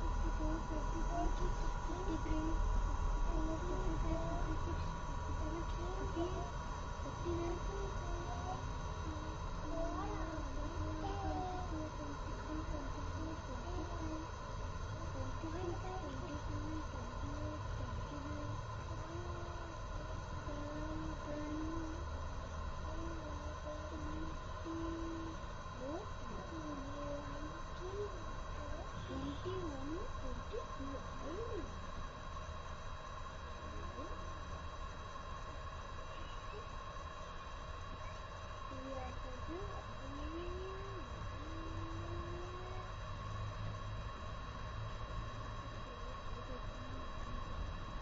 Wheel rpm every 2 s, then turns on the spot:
0, 0, 0, 0, 0, 0, 0, 0, 0, 0, 0, 0, 0, 0, 0, 0, 0, 0, 0, 0, 0, 0, 0, 0.
none